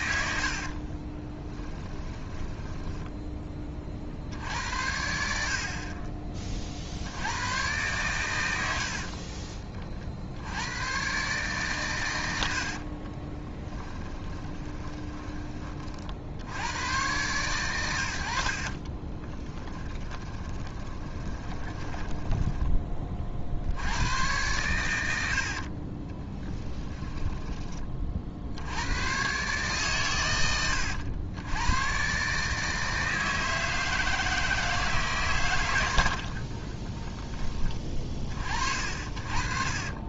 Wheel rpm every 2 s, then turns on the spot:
50, 10, 70, 40, 80, 110, 70, 20, 100, 50, 20, 20, 110, 10, 90, 100, 160, 160, 30, 40.
0-4 8-10 12-16 18-22 26-28 36-38